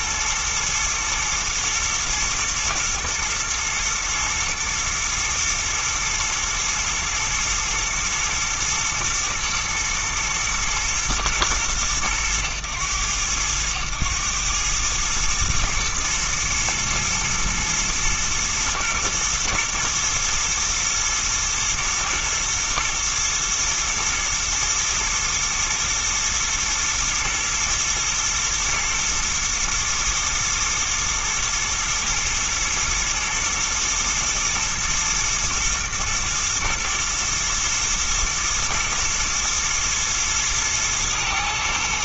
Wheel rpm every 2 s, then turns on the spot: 110, 110, 110, 110, 120, 120, 100, 110, 110, 120, 110, 110, 120, 110, 120, 110, 120, 110, 110, 120, 120.
none